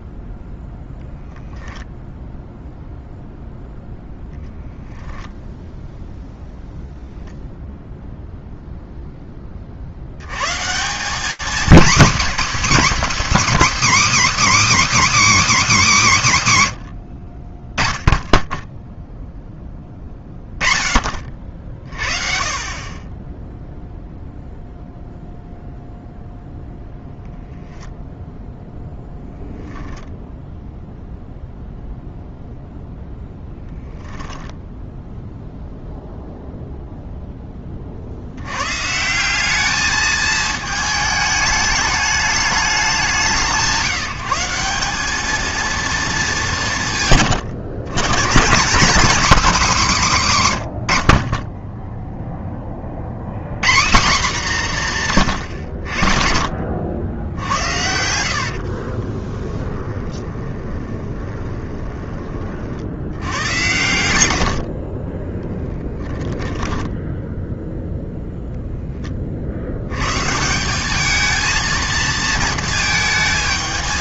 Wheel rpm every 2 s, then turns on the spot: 0, 0, 0, 0, 0, 130, 260, 300, 150, 0, 30, 20, 0, 0, 10, 0, 0, 0, 0, 140, 220, 170, 200, 140, 220, 90, 30, 190, 60, 50, 20, 50, 60, 10, 0, 160, 230.
58-62 64-68